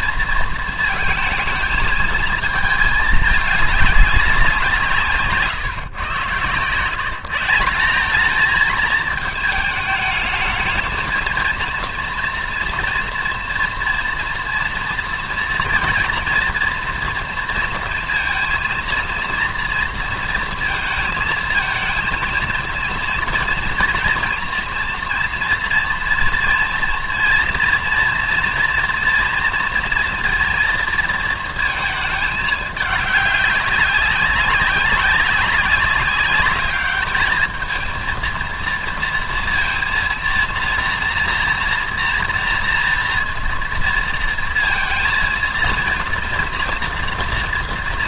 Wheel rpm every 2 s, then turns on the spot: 230, 220, 170, 130, 220, 220, 240, 230, 240, 230, 230, 230, 230, 230, 240, 230, 210, 200, 210, 230, 230, 230, 230, 240.
none